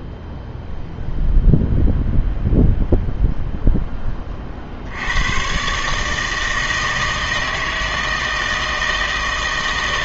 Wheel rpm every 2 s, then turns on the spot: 0, 0, 60, 160, 160.
none